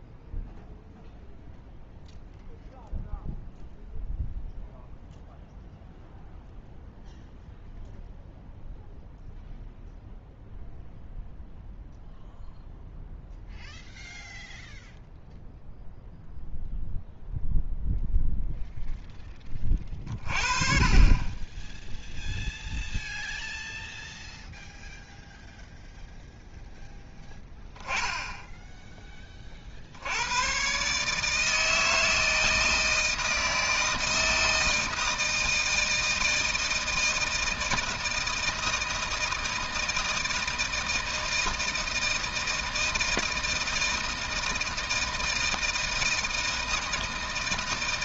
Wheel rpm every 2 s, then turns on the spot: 0, 0, 0, 0, 0, 0, 0, 0, 0, 0, 30, 0, 0, 10, 10, 140, 160, 160, 160, 160, 160, 160, 160, 160.
none